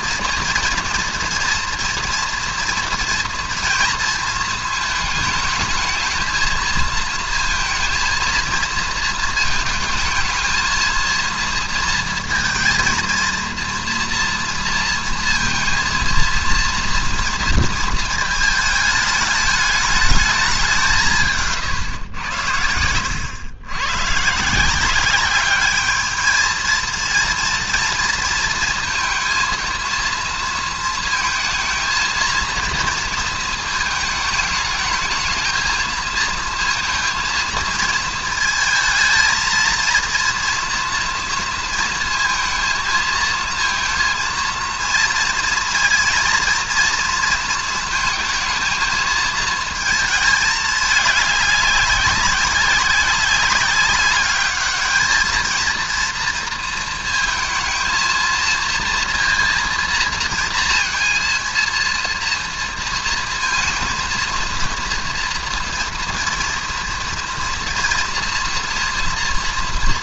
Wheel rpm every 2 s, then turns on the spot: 230, 230, 220, 220, 230, 220, 230, 230, 230, 220, 190, 90, 160, 220, 230, 230, 230, 210, 230, 220, 240, 230, 230, 230, 230, 210, 190, 210, 230, 230, 230, 230, 230, 230, 230.
none